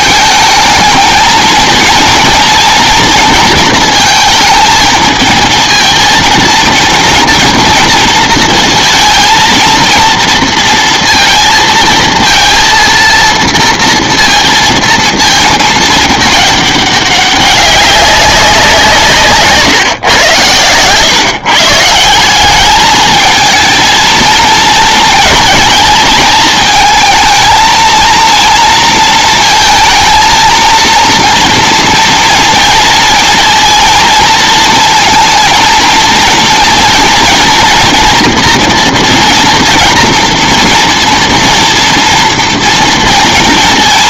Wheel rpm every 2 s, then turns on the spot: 220, 230, 230, 230, 230, 230, 230, 230, 210, 170, 110, 210, 220, 220, 230, 230, 230, 230, 230, 230, 230, 230.
none